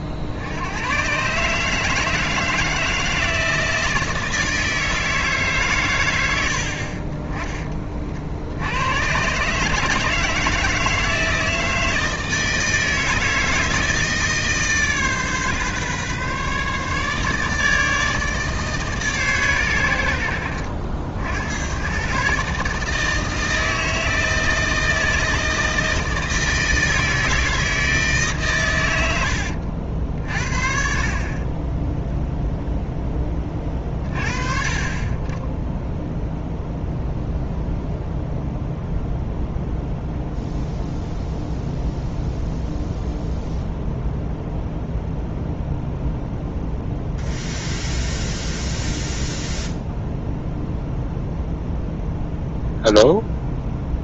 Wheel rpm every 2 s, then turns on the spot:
110, 160, 160, 40, 100, 160, 160, 150, 150, 150, 70, 150, 160, 160, 100, 50, 0, 30, 0, 0, 0, 0, 0, 0, 0, 0, 0.
none